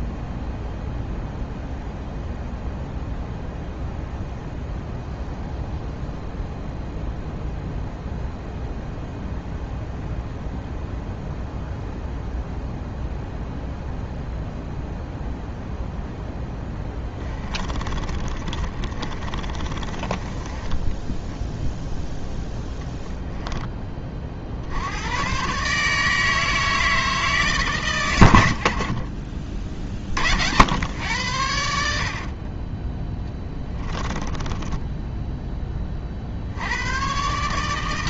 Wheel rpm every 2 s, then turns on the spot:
0, 0, 0, 0, 0, 0, 0, 0, 10, 30, 10, 0, 80, 160, 50, 90, 20, 10, 100.
16-22 34-36